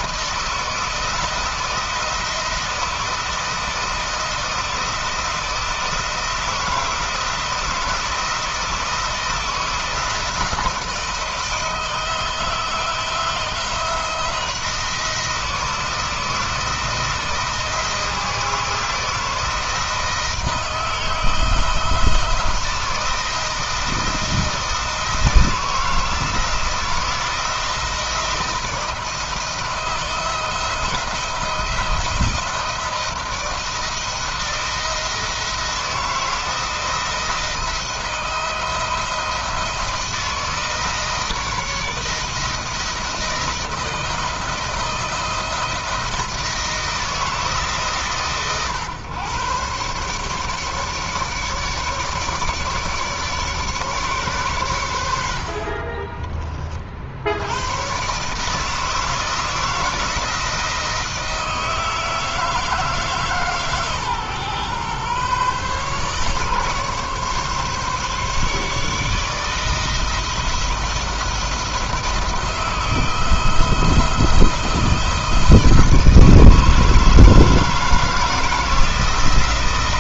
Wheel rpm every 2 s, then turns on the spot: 170, 160, 160, 160, 160, 170, 170, 170, 160, 160, 160, 160, 160, 170, 160, 170, 160, 160, 170, 170, 160, 170, 160, 160, 130, 150, 150, 100, 70, 160, 170, 160, 130, 140, 160, 170, 160, 160, 160, 170.
none